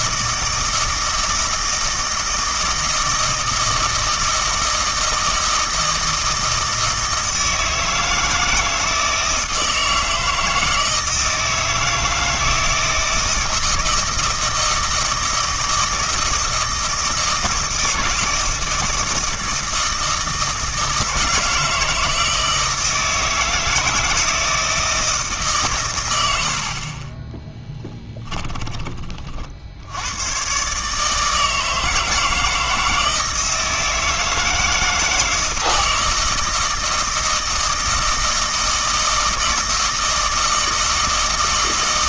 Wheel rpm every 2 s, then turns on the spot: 160, 160, 160, 160, 160, 160, 160, 160, 160, 160, 160, 160, 160, 50, 20, 140, 160, 160, 160, 160, 160.
none